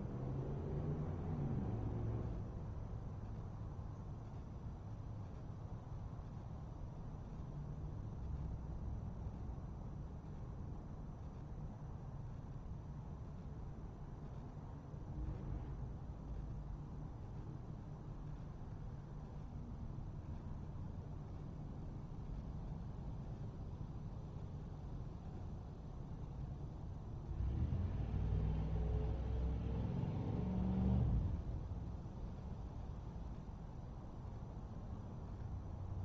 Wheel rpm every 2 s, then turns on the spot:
0, 0, 0, 0, 0, 0, 0, 0, 0, 0, 0, 0, 0, 0, 0, 0, 0, 0.
none